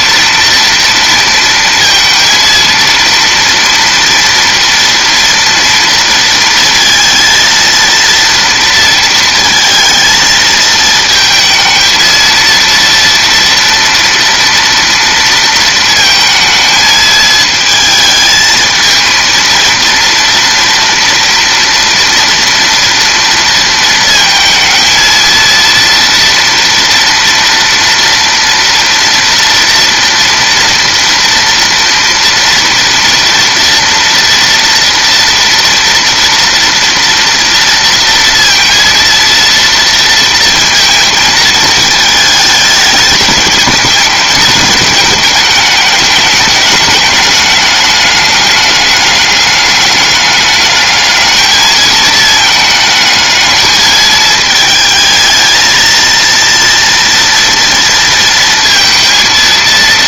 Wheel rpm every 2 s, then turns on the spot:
230, 230, 230, 230, 230, 220, 230, 230, 220, 220, 230, 230, 230, 230, 230, 230, 230, 230, 230, 230, 230, 210, 220, 210, 200, 210, 220, 220, 230, 230.
none